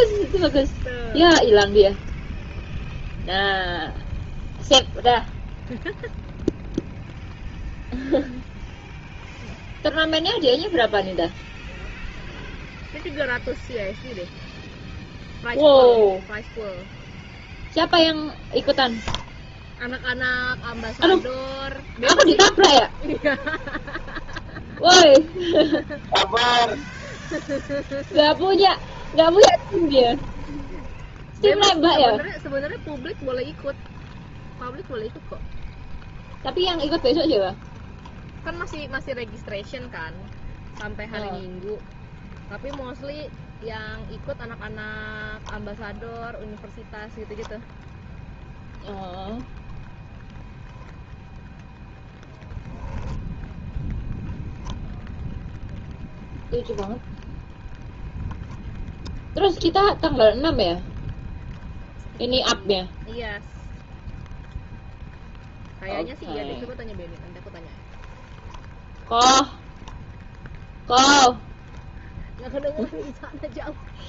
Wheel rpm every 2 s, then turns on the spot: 0, 0, 0, 0, 0, 0, 0, 0, 0, 0, 0, 20, 0, 0, 10, 10, 0, 0, 10, 0, 0, 0, 10, 0, 0, 0, 10, 0, 10, 0, 0, 0, 0, 0, 10, 0, 0.
22-24 28-32